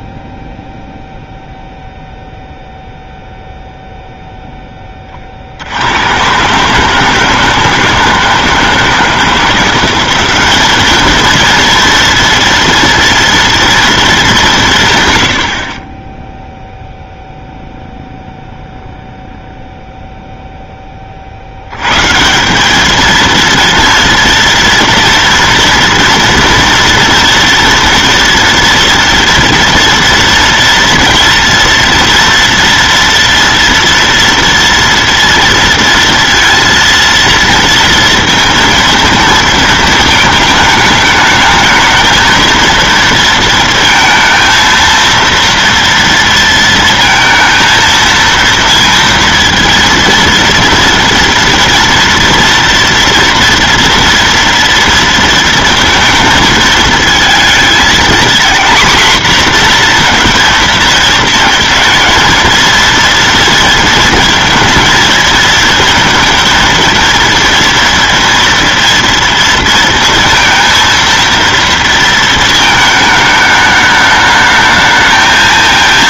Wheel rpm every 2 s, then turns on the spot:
0, 0, 10, 140, 170, 200, 230, 180, 0, 0, 10, 190, 230, 230, 230, 230, 230, 230, 230, 230, 220, 230, 230, 230, 230, 230, 230, 230, 220, 240, 230, 230, 220, 230, 230, 230, 220, 210.
none